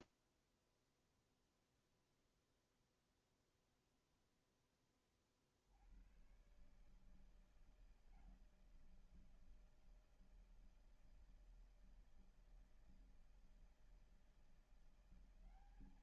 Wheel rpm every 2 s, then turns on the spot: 0, 0, 10, 130, 160, 160, 160, 170.
none